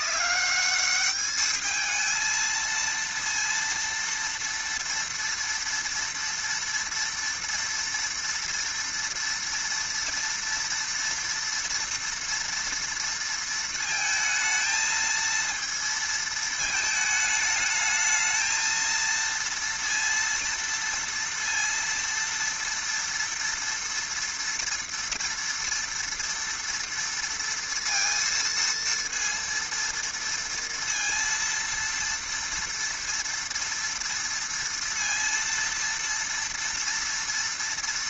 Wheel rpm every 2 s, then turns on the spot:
210, 230, 230, 230, 230, 230, 230, 230, 220, 220, 230, 230, 230, 230, 230, 230, 230, 230, 230.
none